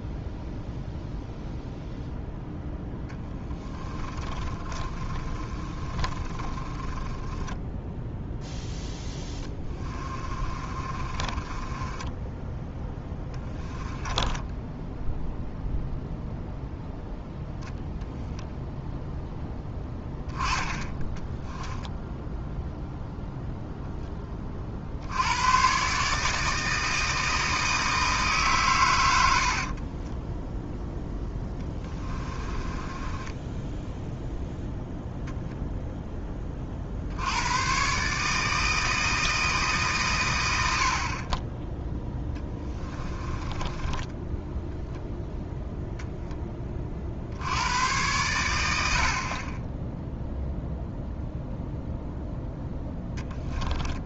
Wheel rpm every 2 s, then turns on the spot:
0, 0, 20, 10, 10, 30, 10, 10, 0, 0, 10, 0, 60, 160, 120, 0, 20, 0, 50, 160, 70, 10, 0, 40, 90, 0, 0.
4-8 10-12 14-16 32-34 42-44